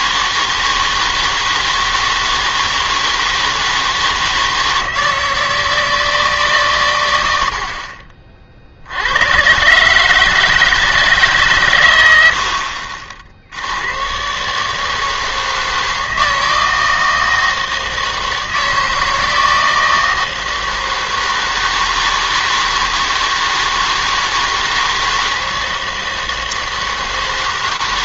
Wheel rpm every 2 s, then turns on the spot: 160, 160, 160, 140, 50, 160, 70, 150, 160, 160, 160, 160, 160, 160.
none